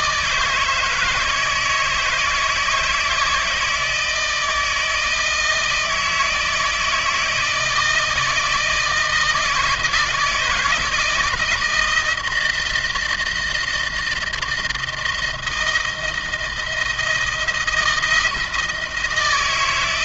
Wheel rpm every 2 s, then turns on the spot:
160, 160, 160, 160, 160, 160, 160, 170, 160, 160.
none